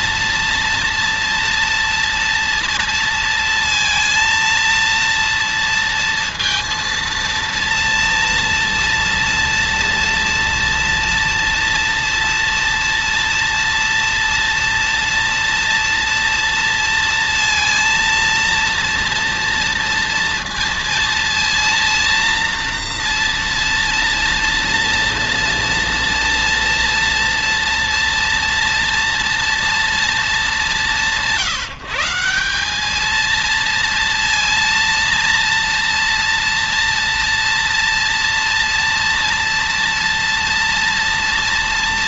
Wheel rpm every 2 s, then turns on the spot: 230, 230, 230, 230, 230, 230, 230, 230, 230, 230, 230, 230, 230, 230, 230, 210, 190, 230, 230, 230, 230.
none